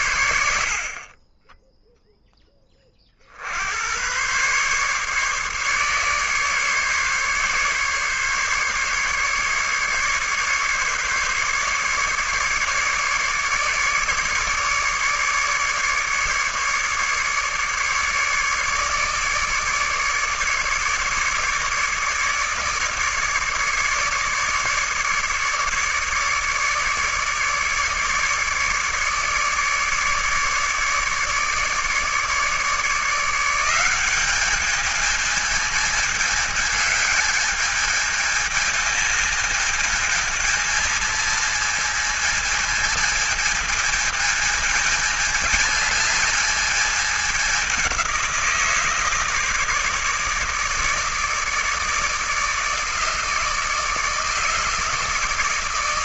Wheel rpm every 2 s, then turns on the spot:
30, 70, 140, 140, 150, 150, 150, 150, 150, 150, 150, 150, 150, 150, 150, 150, 170, 220, 210, 220, 220, 220, 220, 200, 160, 160, 160, 160.
none